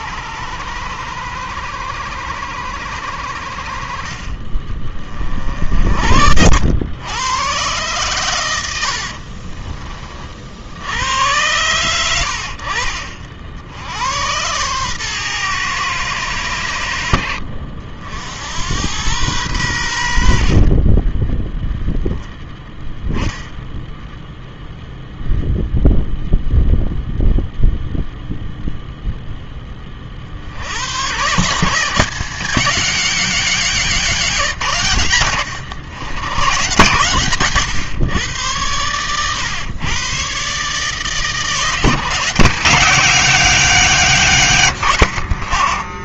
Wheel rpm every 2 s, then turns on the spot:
90, 80, 30, 90, 80, 70, 70, 120, 80, 90, 30, 10, 0, 0, 0, 90, 190, 130, 130, 100, 140, 180, 110.
8-10 20-22